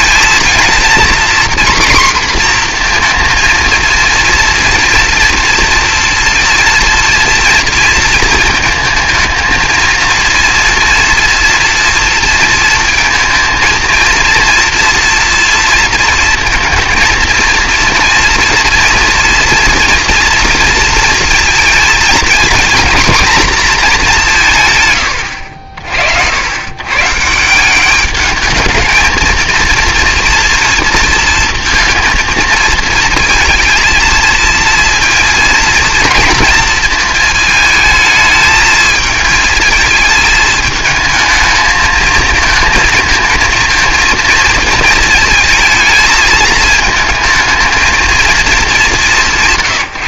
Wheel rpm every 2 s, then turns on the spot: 230, 240, 230, 230, 230, 230, 230, 230, 230, 240, 230, 240, 150, 110, 220, 230, 220, 230, 230, 220, 220, 220, 230, 220, 220.
none